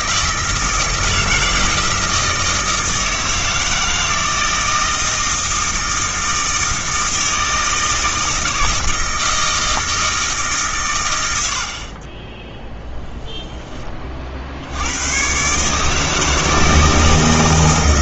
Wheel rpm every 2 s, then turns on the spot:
160, 160, 160, 160, 160, 140, 10, 80, 160.
12-14